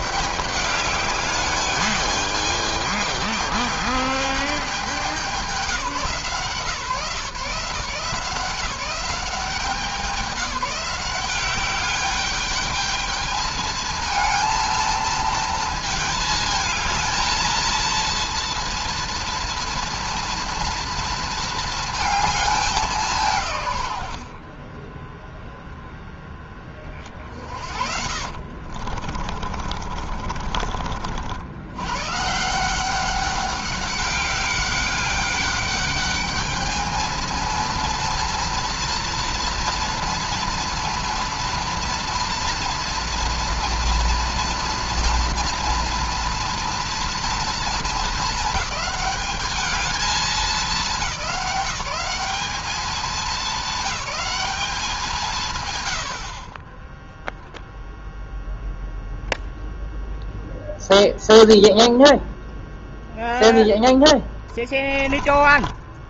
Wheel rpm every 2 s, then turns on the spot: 210, 210, 200, 150, 180, 180, 210, 230, 220, 230, 230, 190, 20, 20, 40, 40, 180, 200, 220, 230, 230, 230, 240, 240, 210, 210, 210, 190, 20, 0, 0, 0, 10.
24-26 28-30 64-66